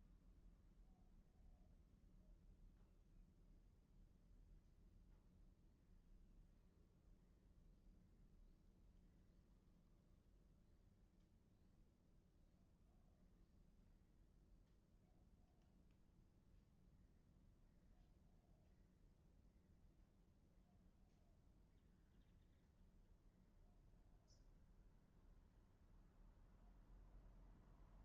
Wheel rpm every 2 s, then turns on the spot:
0, 0, 0, 0, 0, 0, 0, 0, 0, 0, 0, 0, 0, 0.
none